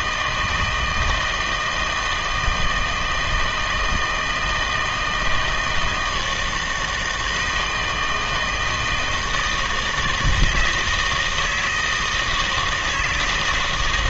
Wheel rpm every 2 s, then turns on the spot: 160, 160, 160, 160, 160, 160, 160.
none